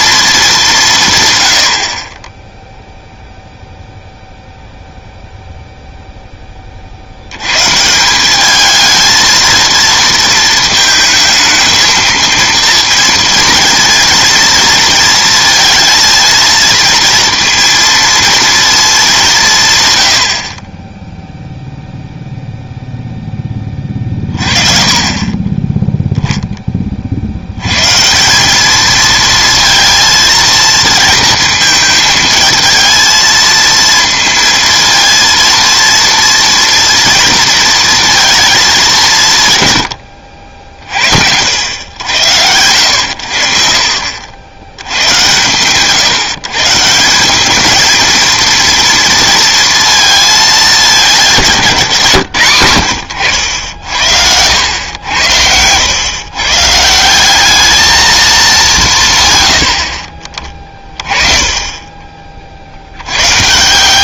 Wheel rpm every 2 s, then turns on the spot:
200, 0, 0, 20, 200, 220, 230, 230, 230, 230, 50, 0, 30, 10, 200, 230, 230, 230, 230, 220, 60, 90, 90, 160, 230, 220, 100, 90, 140, 210, 40, 50.
none